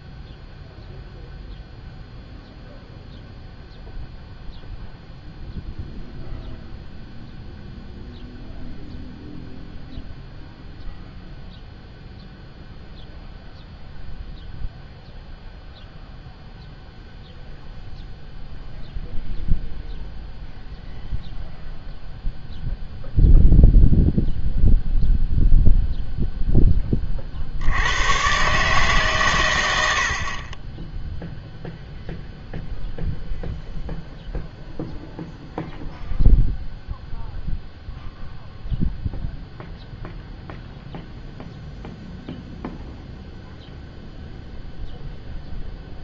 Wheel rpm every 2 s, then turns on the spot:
0, 0, 0, 0, 0, 0, 0, 0, 0, 0, 0, 0, 0, 10, 140, 20, 0, 0, 0, 0, 0, 0, 0.
none